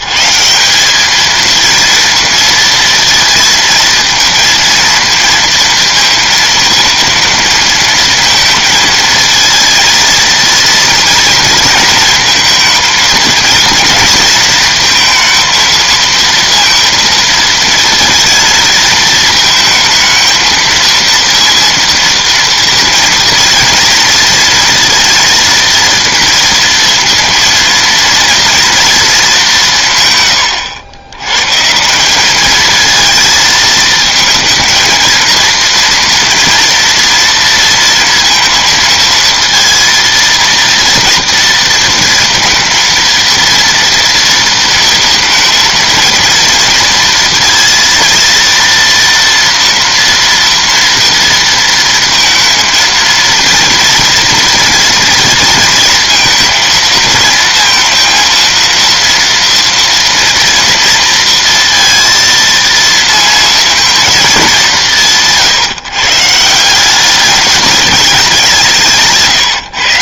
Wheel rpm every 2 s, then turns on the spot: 180, 230, 230, 230, 230, 230, 230, 230, 230, 220, 220, 230, 230, 230, 230, 110, 210, 220, 230, 230, 230, 230, 230, 230, 230, 230, 230, 230, 220, 230, 230, 230, 210, 170, 180.
none